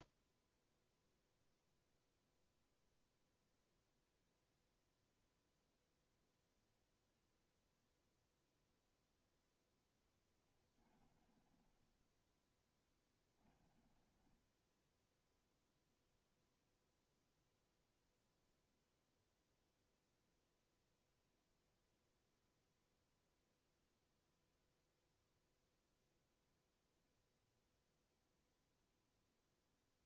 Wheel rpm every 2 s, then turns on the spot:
0, 0, 0, 0, 0, 20, 10, 20, 0, 0, 0, 0, 0, 0, 0.
10-16